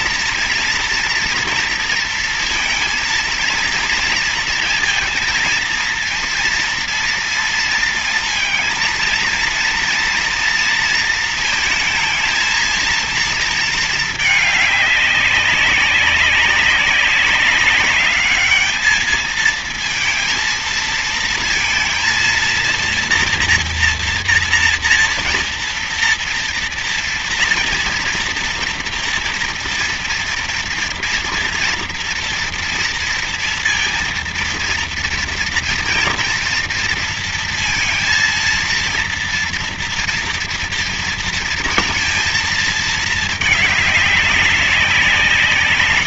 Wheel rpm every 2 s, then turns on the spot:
230, 230, 230, 230, 230, 230, 230, 210, 200, 210, 220, 230, 230, 230, 230, 230, 240, 230, 230, 230, 230, 230, 200.
none